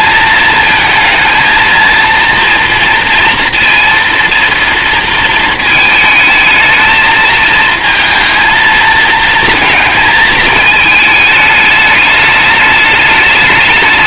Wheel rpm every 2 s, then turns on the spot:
230, 230, 230, 220, 230, 220, 210.
none